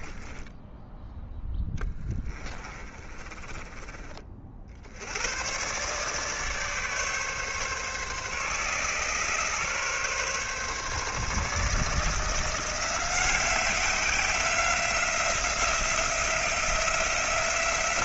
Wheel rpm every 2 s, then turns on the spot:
10, 30, 70, 140, 130, 140, 180, 180, 170.
2-4